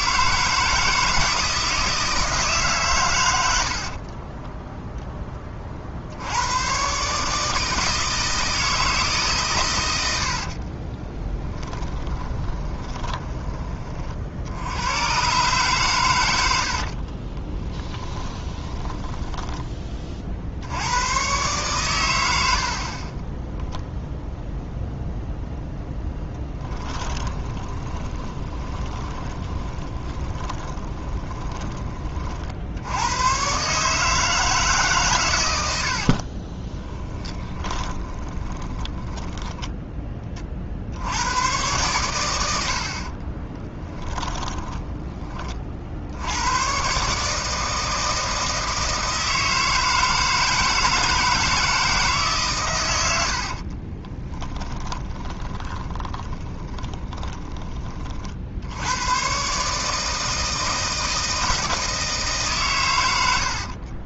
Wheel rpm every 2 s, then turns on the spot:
160, 140, 10, 120, 160, 50, 20, 80, 80, 20, 70, 60, 0, 20, 20, 30, 80, 150, 30, 20, 50, 70, 10, 120, 160, 160, 110, 20, 10, 80, 160, 120.
10-14 18-20 22-24 26-32 36-40 44-46 54-58